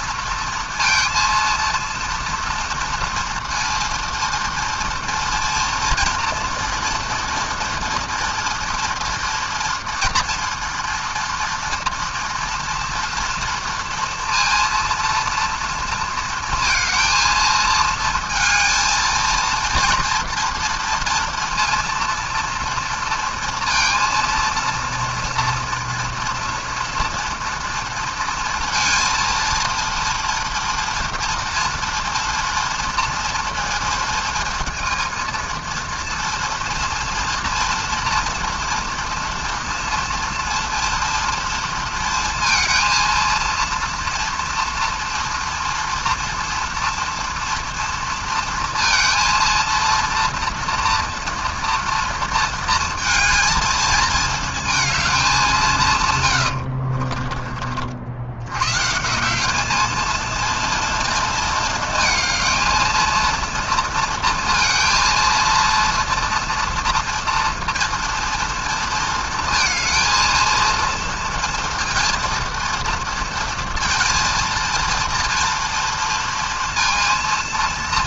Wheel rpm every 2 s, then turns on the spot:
230, 230, 230, 230, 240, 230, 230, 230, 230, 230, 230, 230, 230, 230, 230, 230, 230, 220, 230, 230, 230, 230, 230, 230, 230, 230, 230, 220, 100, 100, 230, 220, 230, 230, 230, 230, 230, 230, 230.
56-58